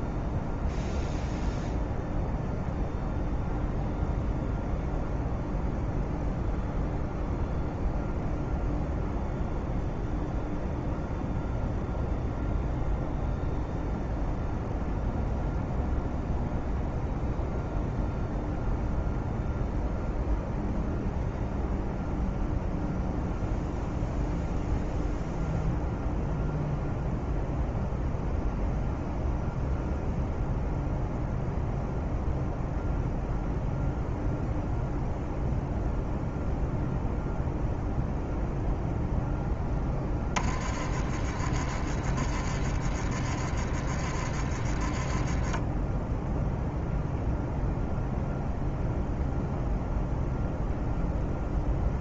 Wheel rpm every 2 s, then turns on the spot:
0, 0, 0, 0, 0, 0, 0, 0, 0, 0, 0, 0, 0, 0, 0, 0, 0, 0, 0, 0, 30, 30, 20, 0, 0, 0.
none